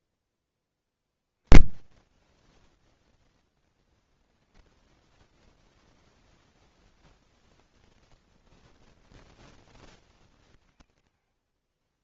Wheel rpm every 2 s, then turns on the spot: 10, 0, 10, 0, 0, 60.
none